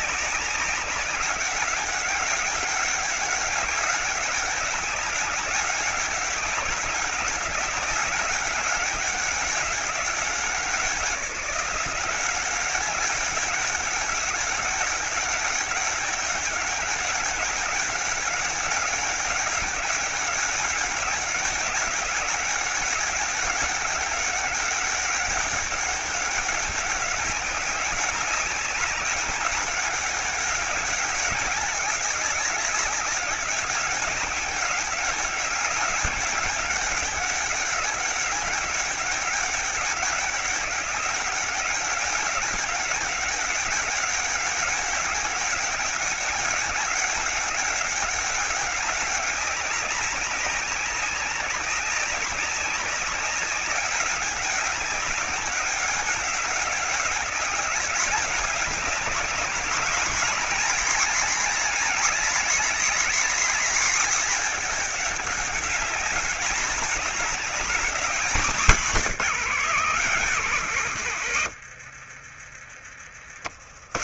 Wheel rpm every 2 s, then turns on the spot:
200, 200, 200, 190, 200, 180, 190, 200, 190, 200, 200, 190, 190, 190, 200, 200, 190, 200, 200, 200, 190, 200, 200, 200, 190, 190, 190, 200, 190, 200, 220, 220, 210, 210, 200, 110, 70.
70-72